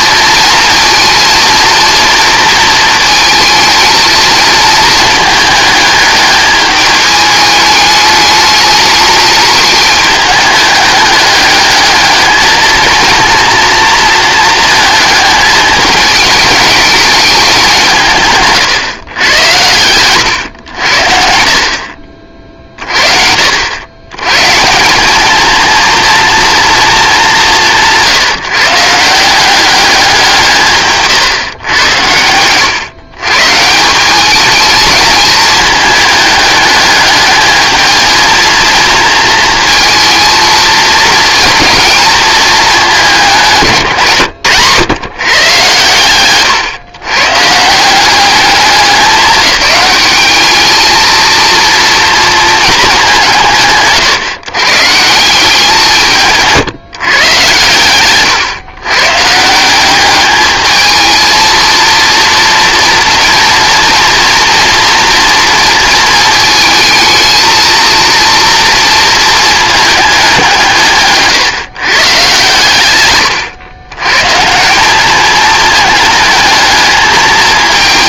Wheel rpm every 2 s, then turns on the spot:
230, 230, 220, 210, 210, 210, 220, 220, 210, 130, 80, 50, 180, 220, 150, 160, 130, 210, 210, 230, 220, 210, 130, 130, 200, 210, 210, 140, 140, 120, 220, 230, 230, 220, 230, 160, 110, 190, 220.
30-32